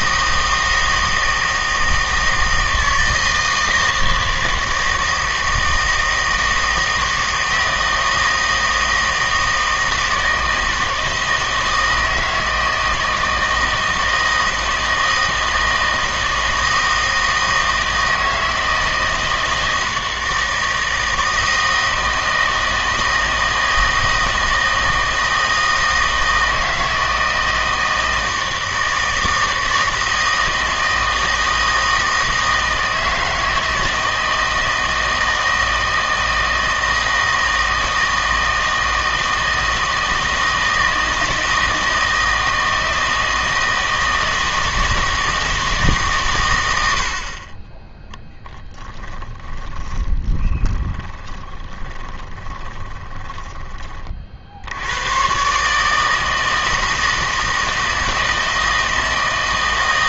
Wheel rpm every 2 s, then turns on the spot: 160, 160, 160, 160, 160, 160, 160, 160, 160, 160, 160, 160, 160, 160, 160, 160, 160, 160, 160, 160, 160, 160, 160, 90, 20, 30, 20, 70, 160, 170.
48-54